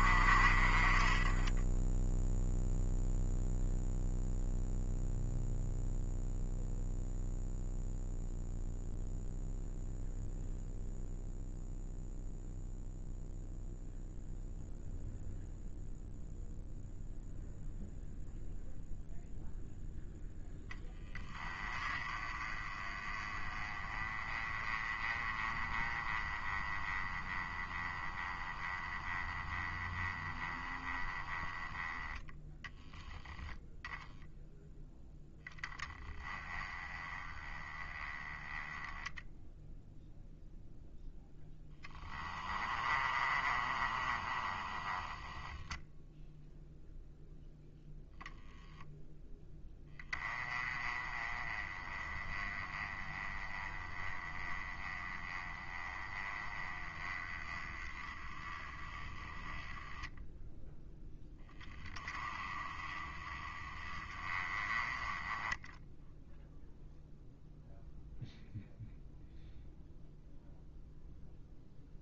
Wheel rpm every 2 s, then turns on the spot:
30, 0, 0, 0, 0, 0, 0, 0, 0, 0, 10, 30, 20, 20, 20, 20, 10, 10, 20, 10, 0, 20, 10, 0, 0, 20, 20, 20, 20, 10, 0, 20, 20, 0, 0, 0.
42-46